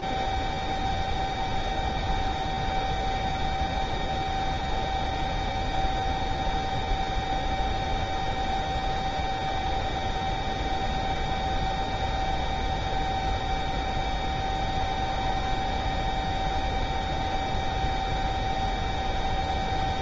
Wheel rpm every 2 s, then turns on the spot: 0, 0, 0, 0, 0, 0, 0, 0, 0, 0.
none